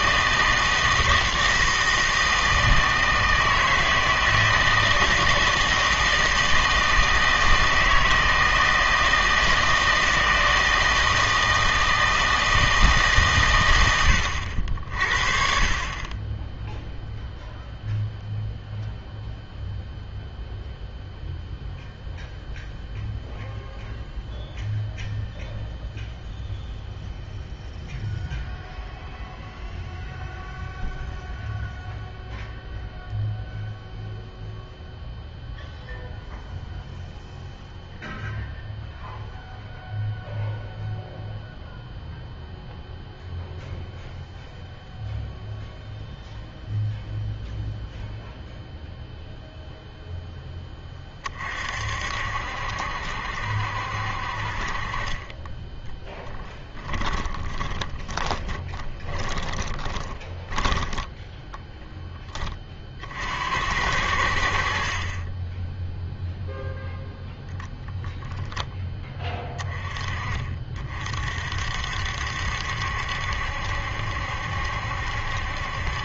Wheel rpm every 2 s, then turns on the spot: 160, 160, 160, 160, 160, 160, 160, 60, 0, 0, 0, 0, 0, 0, 0, 0, 0, 0, 0, 0, 0, 0, 0, 0, 0, 20, 70, 40, 10, 20, 10, 40, 50, 0, 10, 40, 70, 70.
54-60